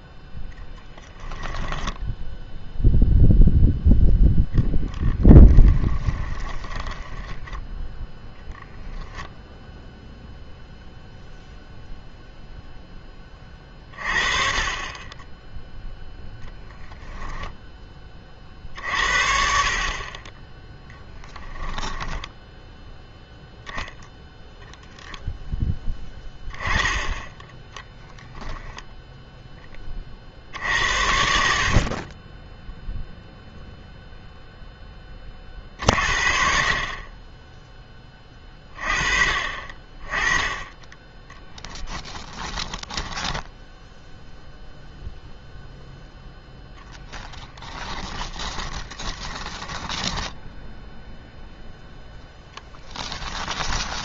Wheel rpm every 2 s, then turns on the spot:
0, 0, 20, 30, 0, 0, 0, 30, 0, 50, 10, 10, 0, 10, 0, 70, 10, 10, 40, 40, 10, 10, 0, 10, 20, 0, 10.
4-8 42-44 48-50 52-54